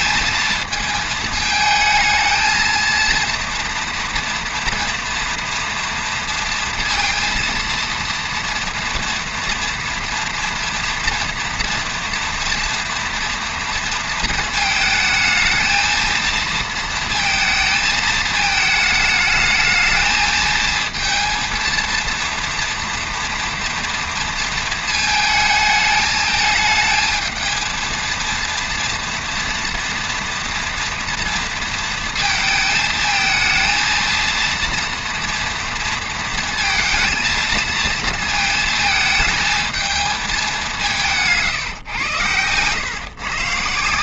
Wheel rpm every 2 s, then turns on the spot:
220, 230, 230, 230, 230, 230, 230, 220, 230, 210, 230, 230, 220, 220, 230, 240, 220, 230, 230, 220, 160, 140.
none